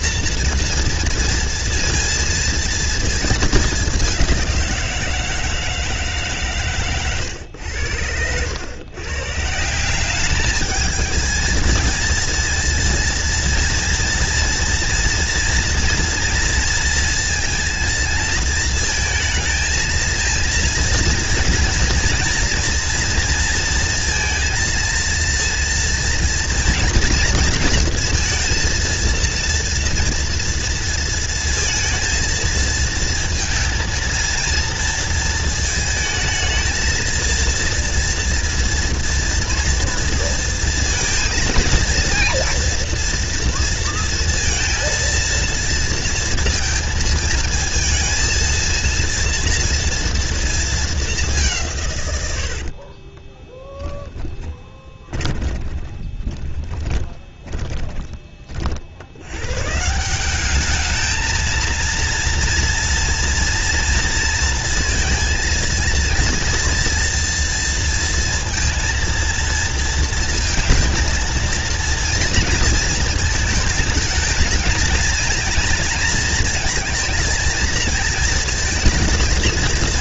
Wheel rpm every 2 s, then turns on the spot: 230, 230, 180, 130, 100, 210, 230, 240, 230, 220, 230, 230, 230, 230, 230, 230, 230, 230, 220, 230, 230, 230, 230, 230, 230, 220, 60, 10, 20, 50, 210, 230, 220, 230, 230, 220, 230, 220, 230, 230.
52-58